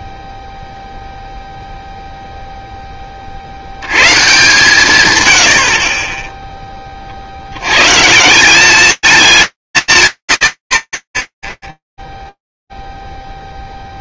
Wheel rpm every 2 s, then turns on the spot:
0, 10, 140, 40, 200, 0, 0.
none